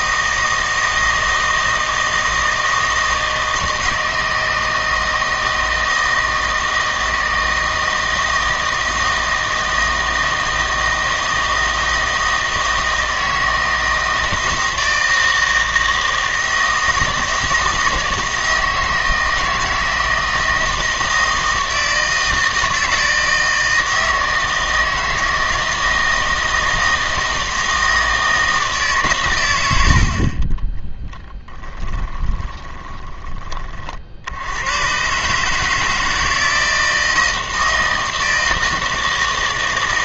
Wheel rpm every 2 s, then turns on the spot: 160, 160, 160, 160, 160, 160, 160, 160, 160, 160, 160, 160, 160, 160, 160, 20, 20, 100, 160, 160.
32-34